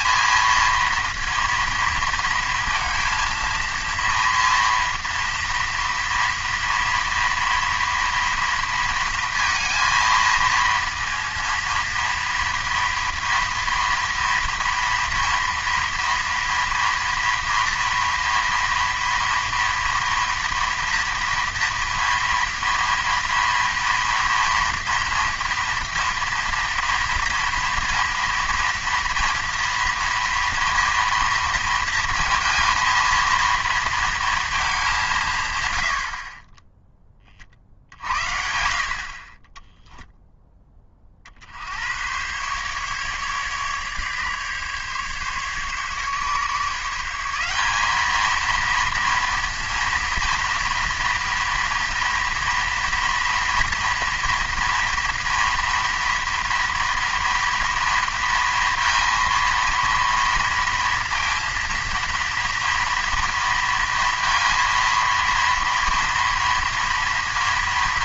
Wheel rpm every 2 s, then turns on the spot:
230, 230, 230, 230, 230, 230, 230, 230, 240, 230, 230, 230, 230, 240, 230, 230, 230, 210, 20, 60, 20, 130, 140, 160, 230, 230, 230, 230, 230, 230, 230, 230, 230, 230.
none